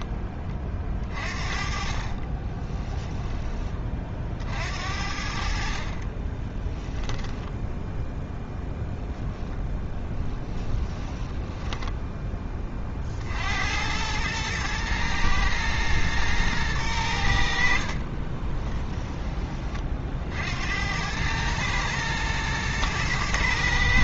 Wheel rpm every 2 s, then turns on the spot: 20, 20, 50, 20, 0, 10, 20, 110, 110, 20, 70, 110.
2-4 6-8 10-12 18-20